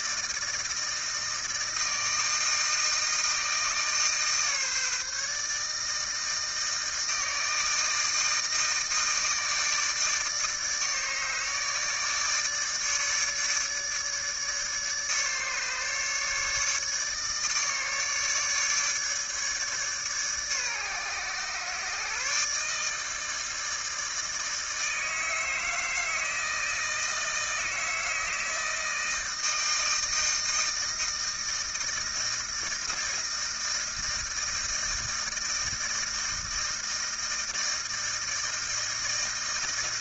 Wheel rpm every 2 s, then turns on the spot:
160, 160, 150, 160, 160, 150, 150, 150, 150, 150, 140, 150, 160, 160, 160, 160, 160, 160, 160, 160.
none